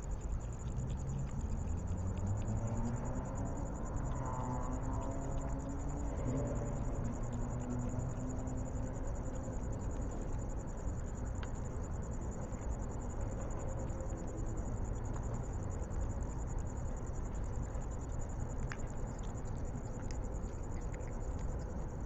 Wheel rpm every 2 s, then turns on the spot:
0, 0, 0, 0, 0, 0, 0, 0, 0, 0, 0.
none